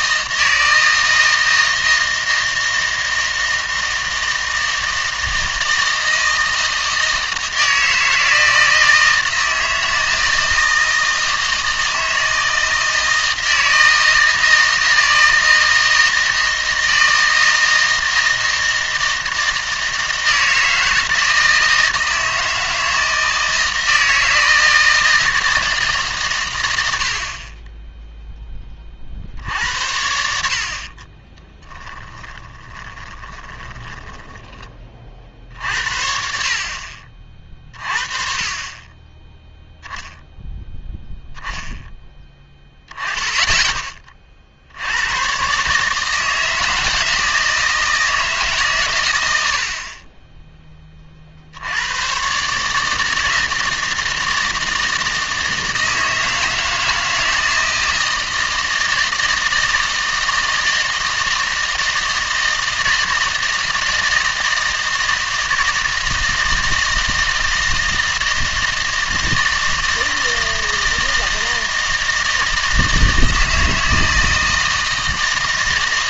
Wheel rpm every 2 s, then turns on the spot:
160, 160, 160, 160, 160, 160, 160, 160, 160, 160, 160, 160, 160, 100, 20, 50, 20, 20, 50, 30, 0, 10, 60, 160, 130, 20, 150, 160, 160, 160, 160, 160, 160, 160, 160, 160, 160, 160.
32-34